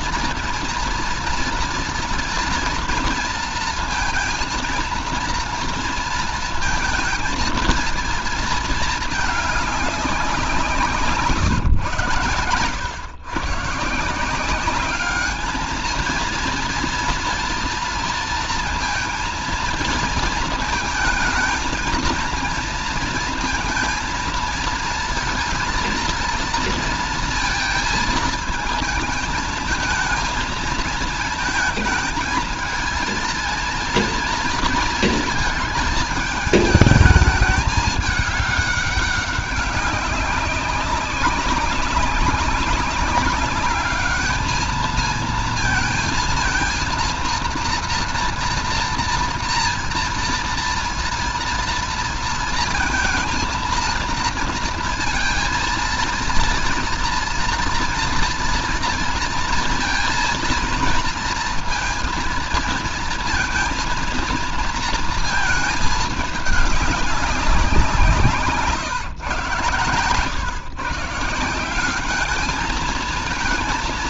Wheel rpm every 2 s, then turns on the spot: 230, 230, 230, 230, 220, 180, 120, 180, 230, 230, 230, 230, 230, 230, 220, 220, 220, 230, 220, 210, 190, 200, 220, 230, 230, 230, 230, 230, 230, 230, 230, 230, 230, 210, 170, 120, 210.
none